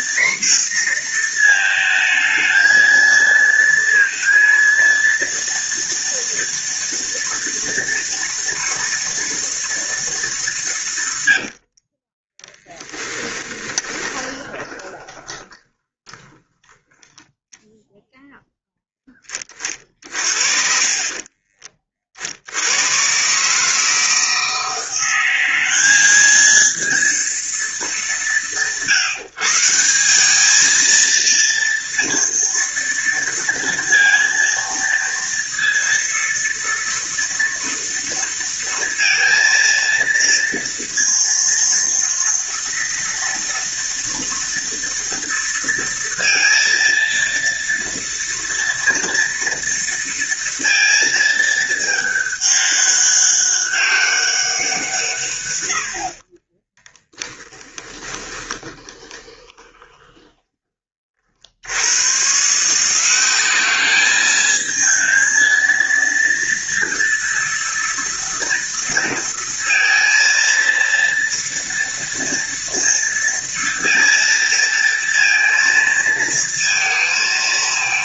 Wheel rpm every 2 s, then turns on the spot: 240, 220, 230, 230, 230, 200, 10, 20, 10, 0, 40, 70, 160, 220, 170, 210, 230, 230, 230, 230, 230, 230, 240, 230, 240, 230, 200, 190, 40, 20, 20, 150, 220, 230, 230, 230, 230, 230, 230.
12-18 56-60